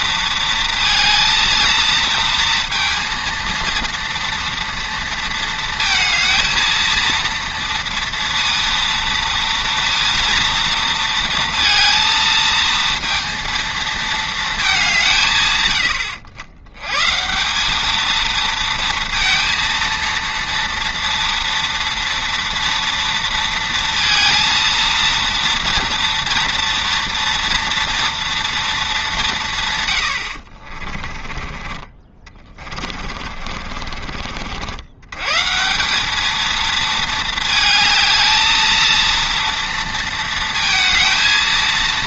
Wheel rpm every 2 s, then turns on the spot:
230, 230, 230, 230, 230, 230, 230, 210, 110, 230, 230, 230, 230, 230, 220, 60, 20, 70, 220, 220, 220.
30-34